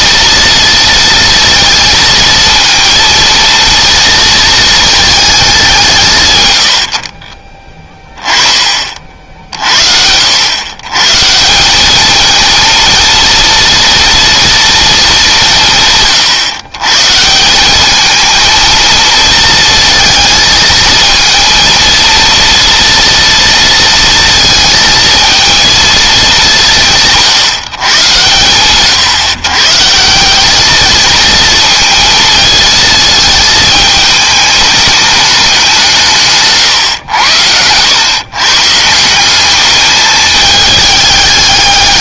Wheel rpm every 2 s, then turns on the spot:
230, 230, 220, 60, 40, 130, 230, 230, 140, 230, 220, 230, 230, 170, 120, 220, 220, 210, 120, 160, 210.
none